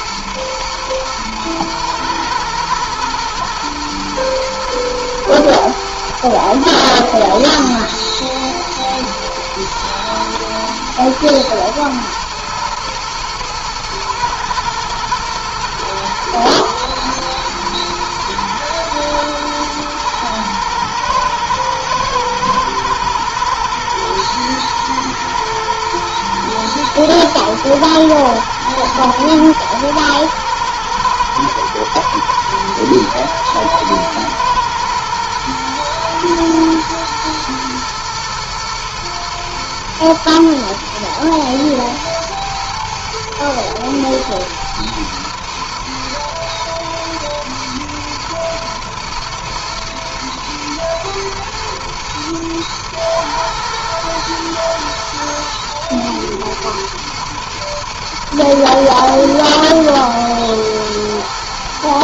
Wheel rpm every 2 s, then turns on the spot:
120, 120, 120, 110, 120, 110, 120, 120, 110, 110, 110, 110, 110, 110, 110, 110, 110, 120, 120, 110, 110, 110, 110, 120, 110, 110, 110, 120, 110, 120, 120.
none